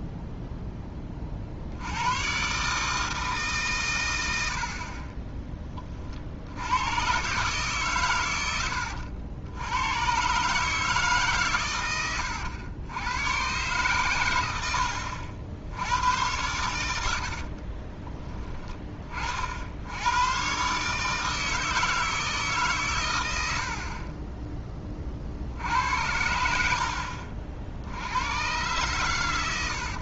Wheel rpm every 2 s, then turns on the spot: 10, 140, 50, 90, 90, 150, 100, 90, 90, 20, 130, 140, 20, 70, 110.
none